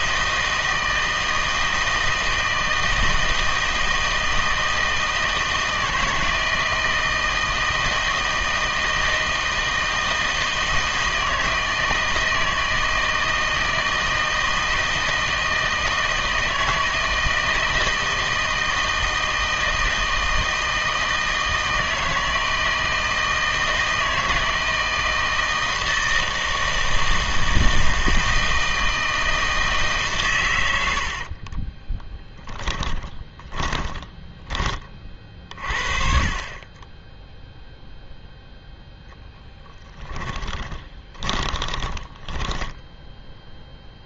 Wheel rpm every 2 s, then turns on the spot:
160, 160, 160, 170, 160, 160, 160, 160, 160, 160, 160, 160, 160, 160, 160, 80, 10, 30, 20, 0, 20, 10.
30-34 40-44